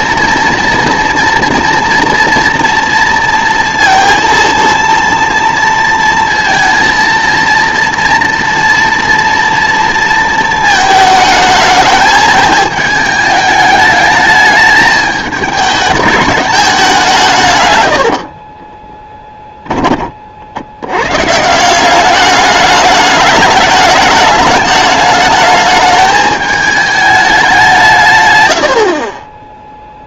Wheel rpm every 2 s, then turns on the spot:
230, 240, 230, 230, 230, 220, 220, 220, 190, 20, 90, 210, 210, 210, 60.
18-20